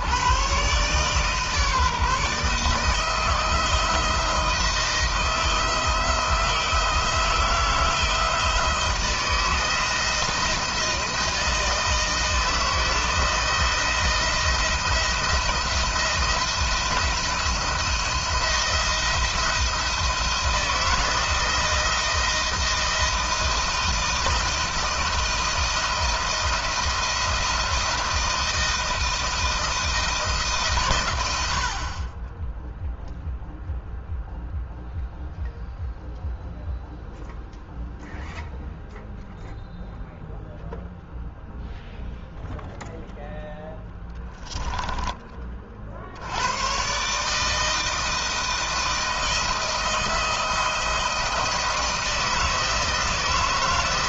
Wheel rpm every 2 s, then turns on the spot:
130, 160, 170, 160, 160, 170, 160, 170, 170, 170, 160, 170, 170, 160, 170, 110, 0, 0, 0, 0, 0, 0, 10, 130, 160, 160, 160.
none